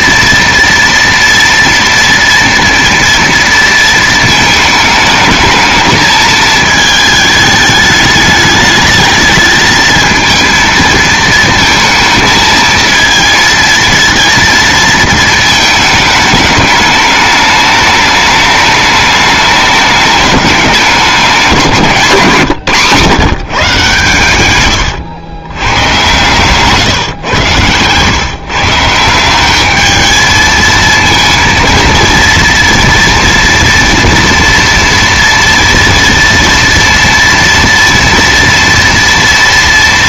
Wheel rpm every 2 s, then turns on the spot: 230, 230, 220, 220, 210, 230, 220, 230, 210, 210, 200, 150, 120, 140, 140, 220, 230, 230, 230, 230.
24-26